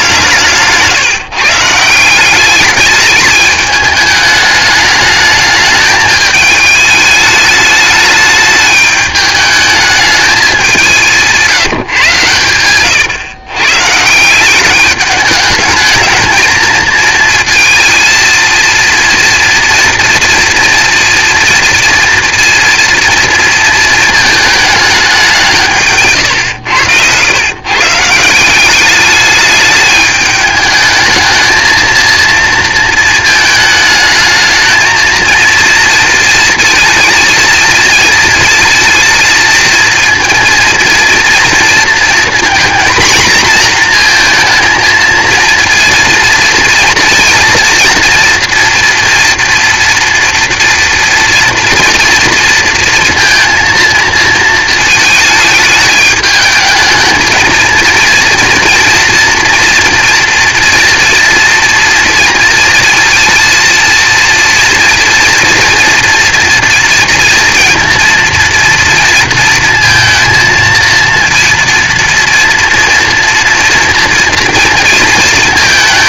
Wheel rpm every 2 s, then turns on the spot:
150, 200, 210, 220, 210, 200, 110, 190, 230, 230, 230, 230, 220, 110, 190, 210, 230, 220, 230, 230, 230, 240, 220, 230, 230, 230, 230, 220, 210, 230, 230, 230, 240, 230, 230, 230, 230, 230.
12-14 26-28